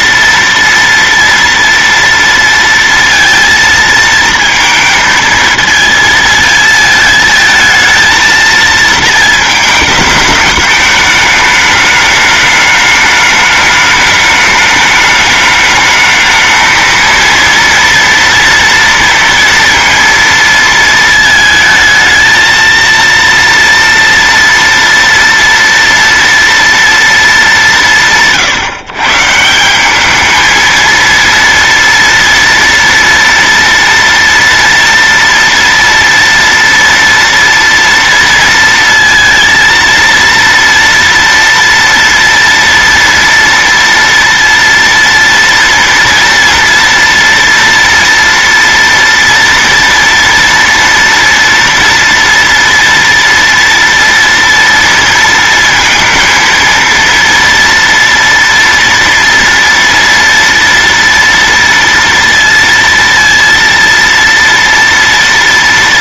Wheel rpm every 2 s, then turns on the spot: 230, 230, 230, 220, 220, 210, 210, 210, 220, 230, 230, 230, 230, 230, 150, 220, 230, 230, 230, 230, 230, 230, 230, 230, 230, 230, 230, 230, 230, 240, 230, 230, 230.
none